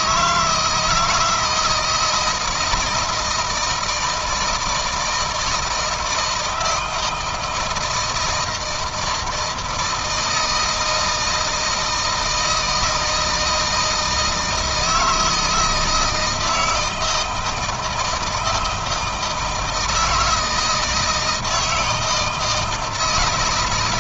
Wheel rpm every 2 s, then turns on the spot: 160, 160, 160, 160, 160, 160, 160, 160, 160, 160, 160, 170.
none